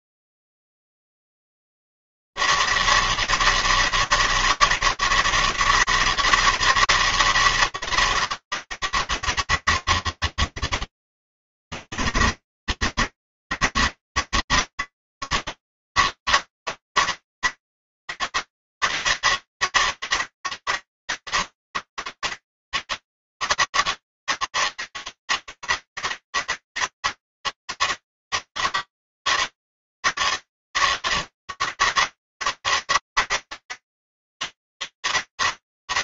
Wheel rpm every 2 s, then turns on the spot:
160, 200, 200, 180, 200, 200, 170, 200, 200, 200, 200, 190, 190, 190, 200, 200, 180, 200.
none